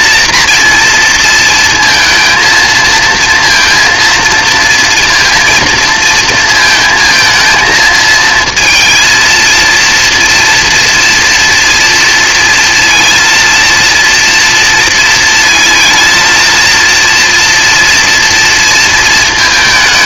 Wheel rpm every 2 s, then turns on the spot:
240, 220, 230, 220, 230, 230, 230, 230, 230, 230.
none